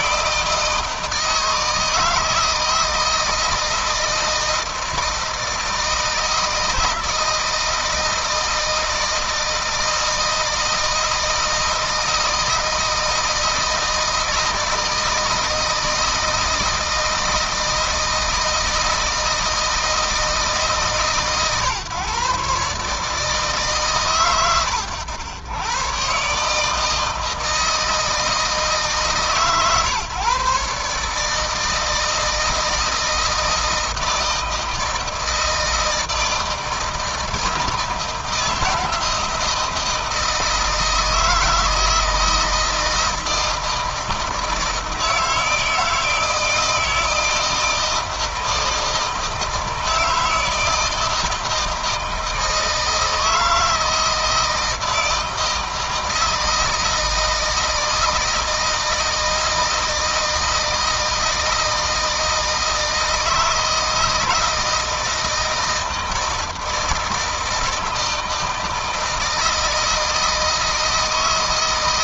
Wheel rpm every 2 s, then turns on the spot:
160, 160, 160, 160, 160, 160, 160, 160, 160, 160, 150, 150, 110, 160, 160, 150, 160, 160, 160, 170, 160, 160, 160, 160, 160, 160, 160, 160, 160, 160, 160, 160, 160, 160, 160, 160.
none